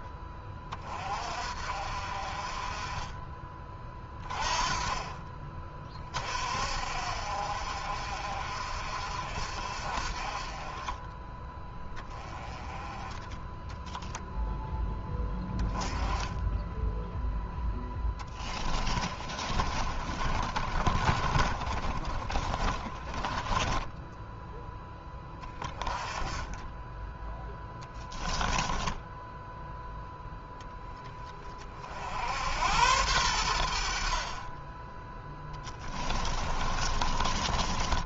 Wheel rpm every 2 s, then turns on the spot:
30, 30, 30, 50, 50, 20, 20, 10, 10, 20, 30, 20, 10, 10, 10, 10, 90, 10, 30.
12-14 18-24 28-30 36-38